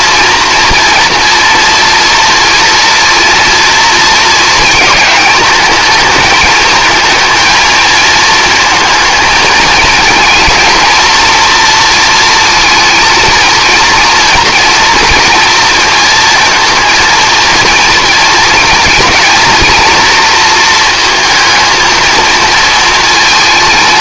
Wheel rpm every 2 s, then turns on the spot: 230, 230, 220, 220, 220, 230, 230, 230, 230, 220, 230, 230.
none